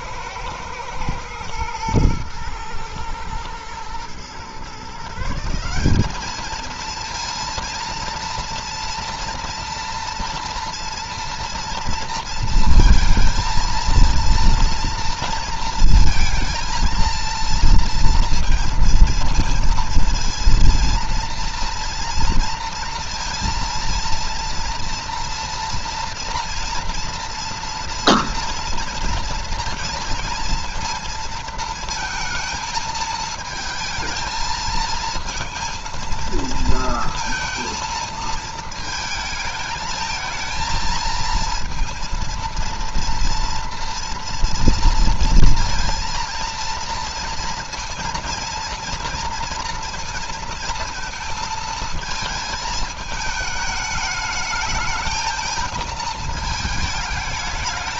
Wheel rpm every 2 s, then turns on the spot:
110, 110, 150, 230, 230, 230, 220, 230, 230, 230, 230, 230, 230, 230, 230, 230, 220, 230, 230, 220, 220, 230, 230, 230, 230, 230, 220, 220, 220.
none